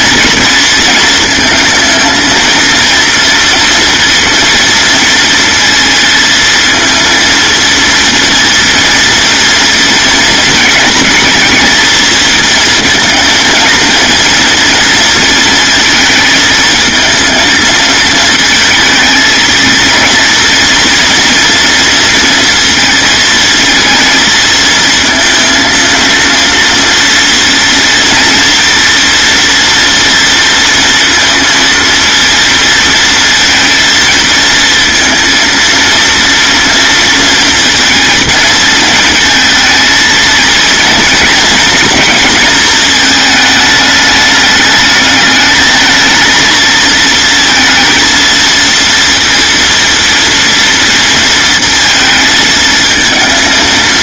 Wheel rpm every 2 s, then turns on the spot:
220, 230, 230, 230, 230, 220, 230, 230, 220, 220, 230, 230, 230, 230, 230, 230, 230, 230, 230, 230, 230, 220, 210, 230, 230, 230, 220.
none